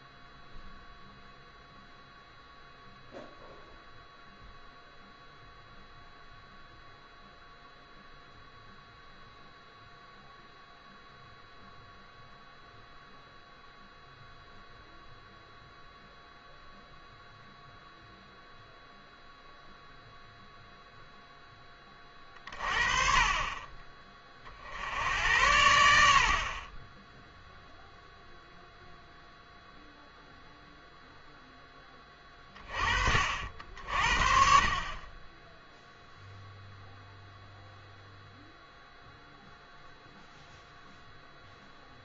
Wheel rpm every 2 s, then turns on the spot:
0, 0, 0, 0, 0, 0, 0, 0, 0, 0, 0, 40, 70, 20, 0, 0, 30, 30, 0, 0, 0.
none